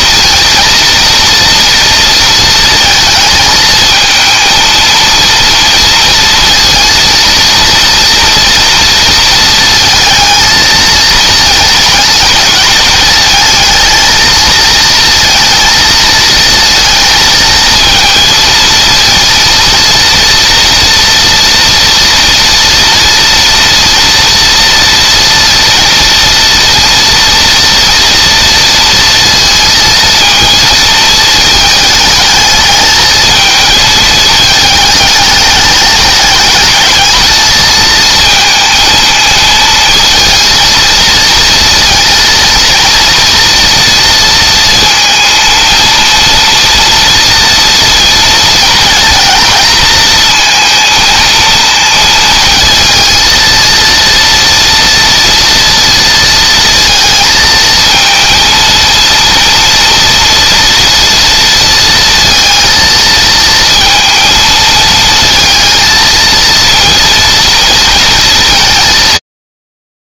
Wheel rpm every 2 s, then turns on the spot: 230, 220, 230, 230, 230, 220, 220, 230, 230, 230, 230, 230, 230, 230, 230, 220, 220, 210, 220, 220, 230, 230, 230, 230, 230, 230, 230, 230, 230, 230, 230, 230, 220, 230, 190.
none